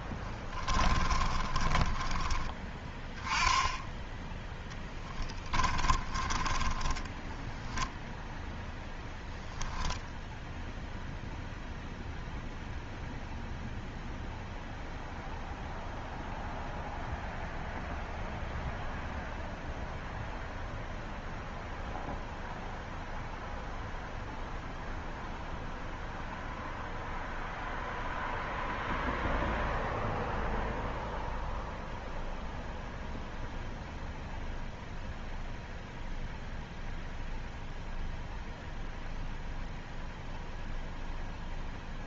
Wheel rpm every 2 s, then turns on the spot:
20, 10, 20, 10, 0, 0, 0, 0, 0, 0, 0, 0, 0, 0, 0, 0, 0, 0, 0, 0, 0.
0-2 4-8